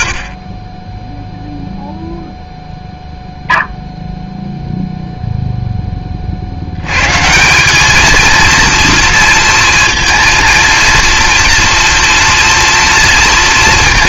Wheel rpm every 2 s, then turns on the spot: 30, 0, 0, 70, 230, 230, 230.
none